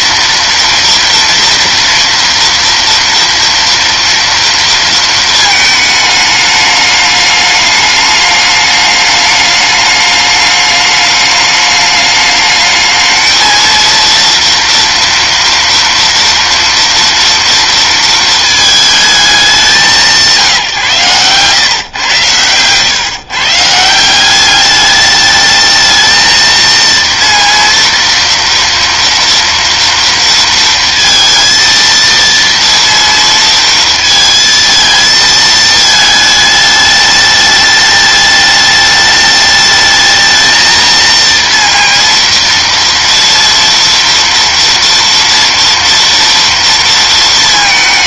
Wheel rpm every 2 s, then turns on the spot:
230, 230, 230, 210, 210, 210, 210, 230, 230, 220, 160, 110, 200, 230, 230, 230, 230, 220, 210, 210, 220, 230, 230, 230.
none